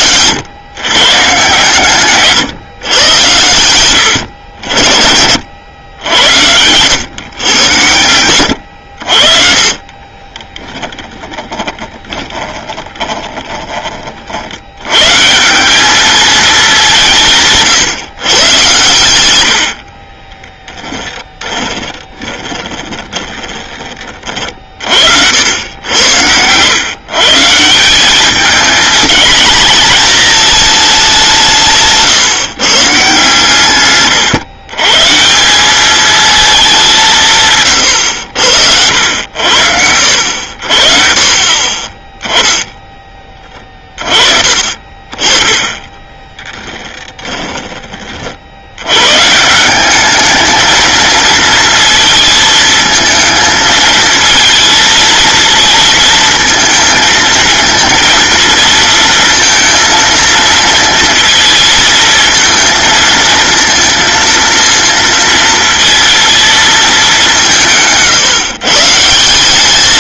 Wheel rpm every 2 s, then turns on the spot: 120, 140, 70, 90, 100, 30, 20, 80, 210, 120, 10, 20, 40, 110, 210, 220, 150, 130, 210, 80, 70, 10, 40, 10, 70, 220, 220, 230, 230, 230, 230, 230, 230, 230, 150.
10-14 20-24 46-48